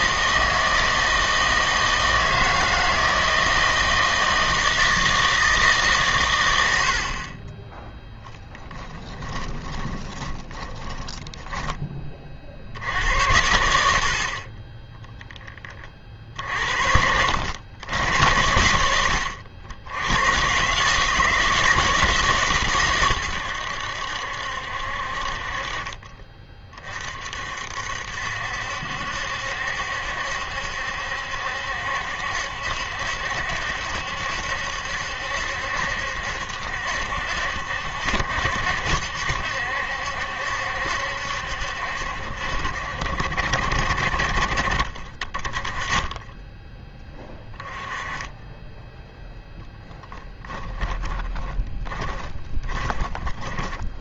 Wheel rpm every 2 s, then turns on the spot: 160, 160, 160, 90, 20, 20, 60, 30, 60, 90, 140, 130, 60, 30, 70, 70, 70, 70, 70, 70, 70, 60, 40, 10, 10, 10, 20.
8-12 50-54